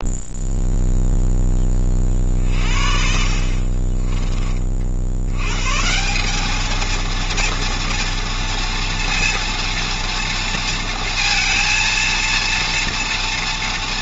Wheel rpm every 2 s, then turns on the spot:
0, 60, 50, 220, 230, 230, 230.
none